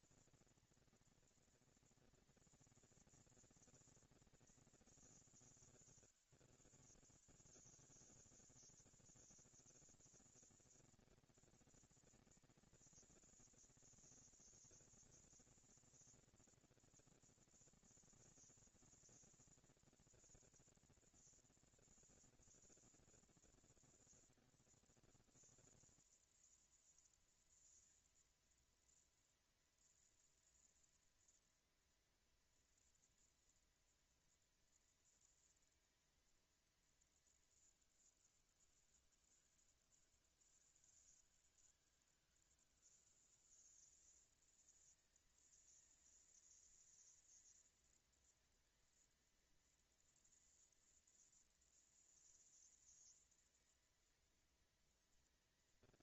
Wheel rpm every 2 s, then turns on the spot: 230, 230, 220, 160, 170, 210, 230, 230, 230, 230, 240, 230, 230, 230, 240, 230, 230, 230, 230, 180, 160, 160, 210, 220, 230, 230, 230, 230.
none